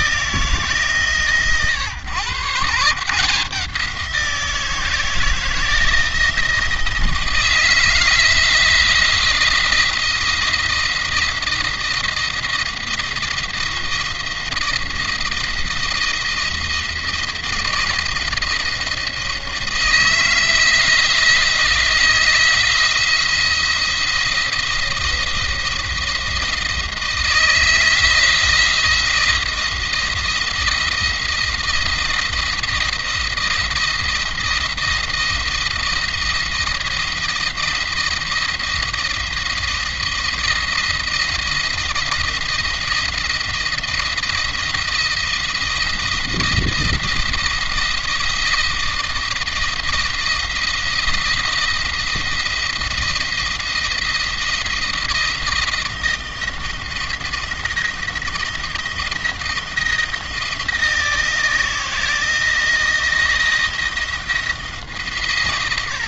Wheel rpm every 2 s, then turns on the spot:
150, 140, 160, 160, 170, 170, 170, 170, 170, 170, 160, 170, 170, 170, 170, 170, 170, 170, 170, 170, 170, 170, 160, 170, 170, 170, 170, 170, 170, 170, 160, 160, 150.
none